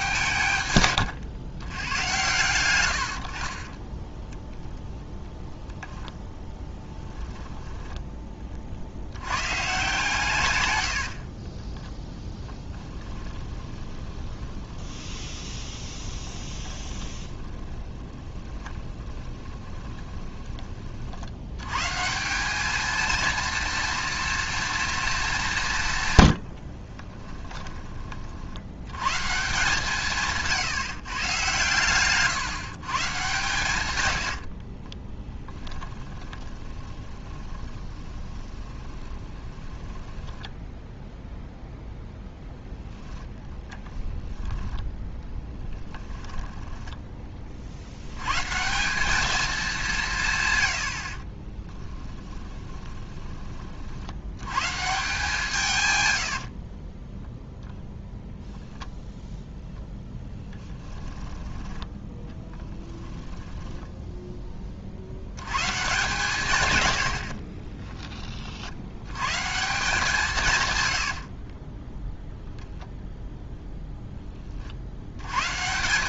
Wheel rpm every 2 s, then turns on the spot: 120, 80, 0, 10, 80, 70, 10, 20, 20, 10, 40, 220, 230, 40, 110, 140, 130, 20, 20, 30, 0, 10, 0, 10, 190, 80, 20, 150, 20, 0, 10, 10, 50, 90, 80, 100, 0, 70.
0-2 12-20 26-28 34-40 46-48 52-54 56-58 60-64 70-72